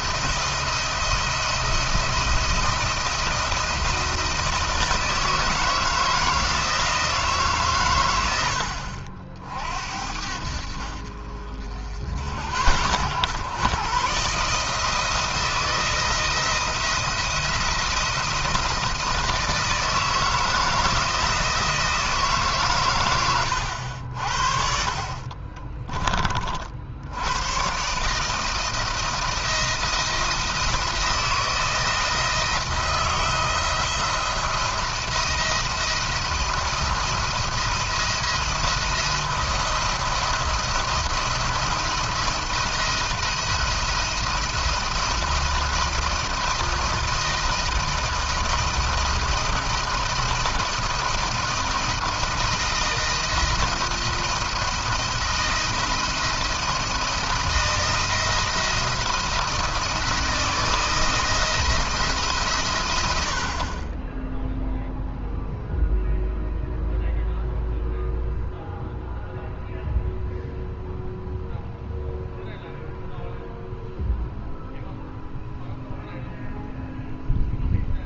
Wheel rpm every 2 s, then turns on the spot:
170, 170, 160, 160, 80, 60, 80, 150, 170, 170, 160, 140, 50, 50, 160, 160, 170, 170, 170, 170, 170, 170, 160, 160, 170, 170, 160, 170, 170, 170, 160, 130, 0, 0, 0, 0, 0, 0, 0.
none